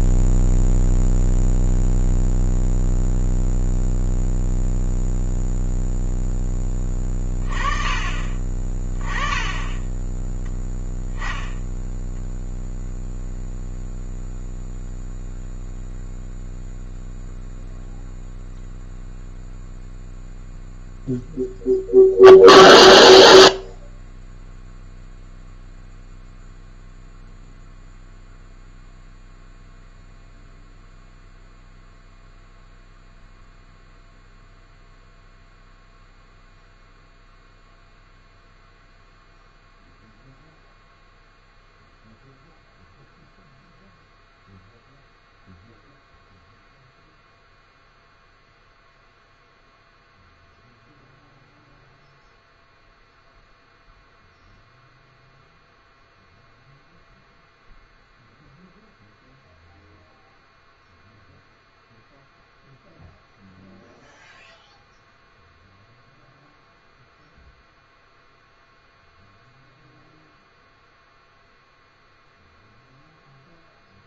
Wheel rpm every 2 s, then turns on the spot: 0, 0, 0, 10, 30, 0, 0, 0, 0, 0, 0, 0, 0, 0, 0, 0, 0, 0, 0, 0, 0, 0, 0, 0, 0, 0, 0, 0, 0, 0, 0, 0, 0, 0, 0, 0, 0.
none